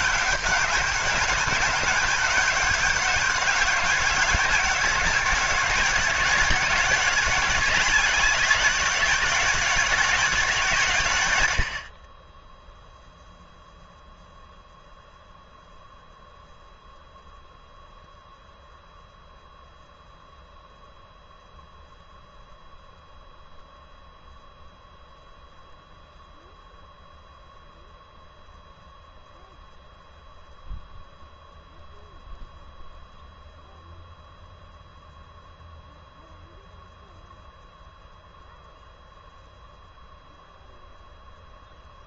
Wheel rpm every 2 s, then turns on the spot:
190, 200, 190, 200, 200, 180, 10, 0, 0, 0, 0, 0, 0, 0, 0, 0, 0, 0, 0, 0, 0.
none